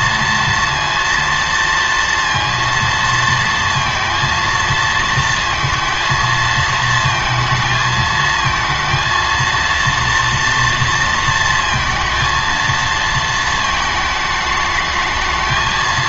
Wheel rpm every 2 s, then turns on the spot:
230, 230, 230, 230, 230, 230, 230, 210.
none